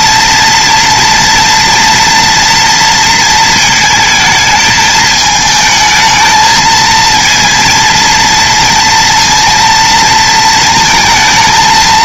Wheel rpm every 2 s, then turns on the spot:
230, 230, 220, 230, 230, 220.
none